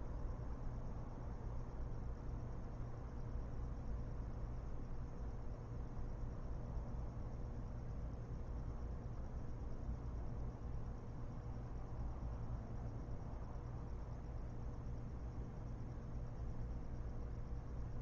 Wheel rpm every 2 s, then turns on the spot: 0, 0, 0, 0, 0, 0, 0, 0, 0.
none